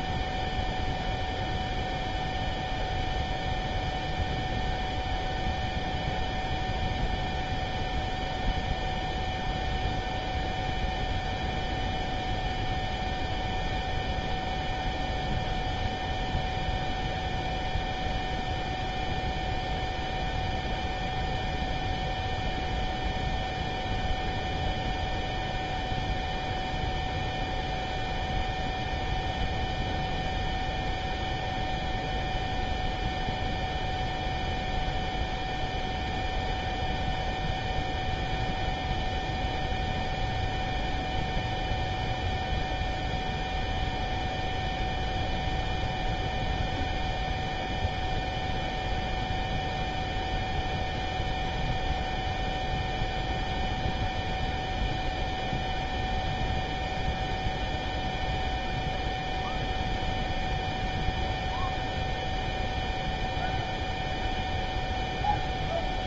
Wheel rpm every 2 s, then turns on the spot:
0, 0, 0, 0, 0, 0, 0, 0, 0, 0, 0, 0, 0, 0, 0, 0, 0, 0, 0, 0, 0, 0, 0, 0, 0, 0, 0, 0, 0, 0, 0, 0, 0.
none